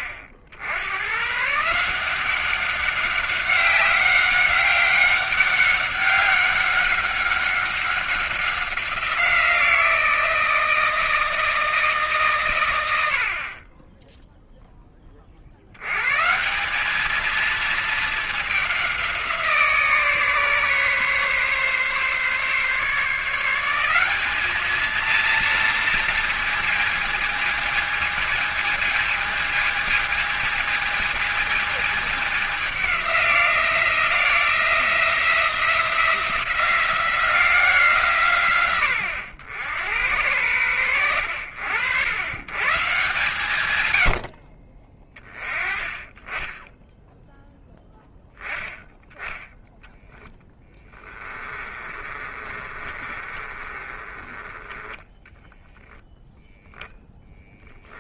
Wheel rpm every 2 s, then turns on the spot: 80, 180, 200, 190, 190, 160, 130, 10, 150, 210, 150, 140, 200, 220, 220, 220, 200, 170, 170, 130, 90, 100, 70, 10, 10, 10, 30, 20, 0.
50-56